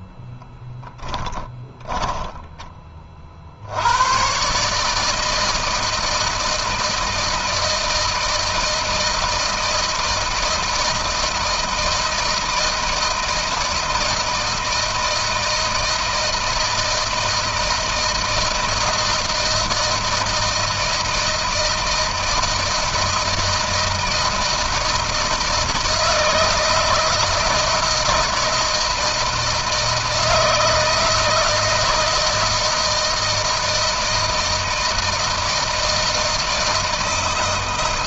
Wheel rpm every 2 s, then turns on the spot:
20, 10, 120, 160, 160, 160, 160, 160, 160, 170, 160, 170, 160, 160, 160, 160, 160, 160, 160.
0-4